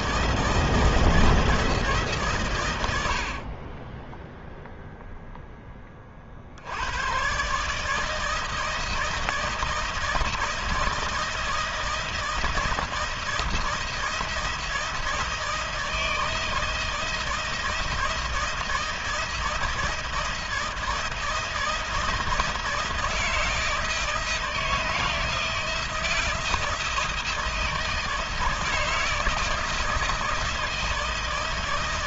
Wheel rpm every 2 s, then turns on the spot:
160, 100, 0, 110, 160, 160, 160, 160, 160, 160, 160, 160, 160, 160, 160, 160.
none